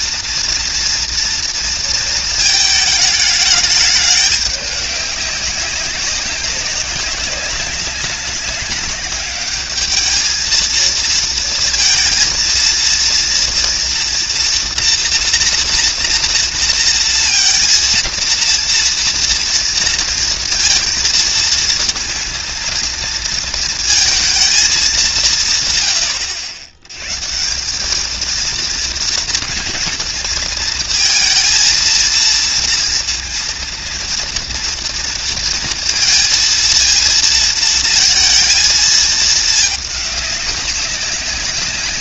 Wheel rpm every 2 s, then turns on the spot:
240, 230, 210, 200, 190, 210, 230, 230, 230, 230, 230, 230, 230, 120, 210, 230, 230, 230, 230, 230, 200.
none